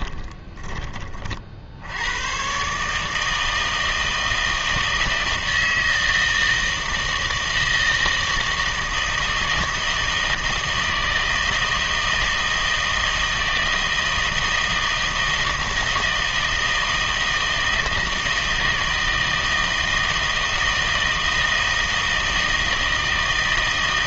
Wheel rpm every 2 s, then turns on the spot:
30, 140, 160, 160, 160, 160, 160, 160, 160, 160, 160, 160.
none